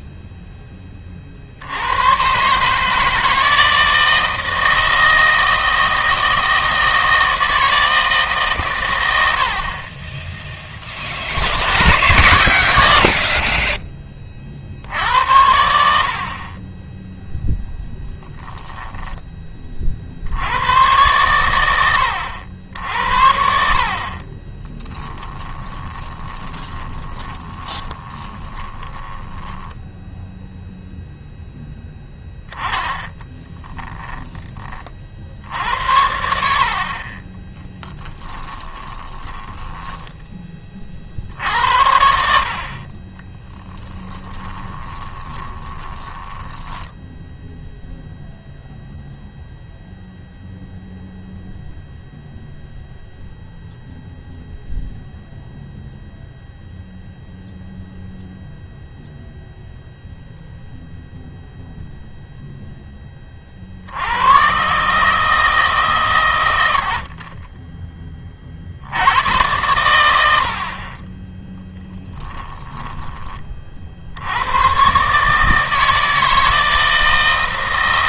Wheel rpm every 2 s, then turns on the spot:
10, 150, 160, 160, 130, 20, 90, 60, 20, 10, 90, 80, 20, 20, 20, 0, 10, 20, 60, 20, 40, 50, 30, 10, 0, 0, 0, 0, 0, 0, 0, 0, 130, 80, 40, 60, 10, 120, 160.
18-20 24-30 32-36 38-40 44-46 72-74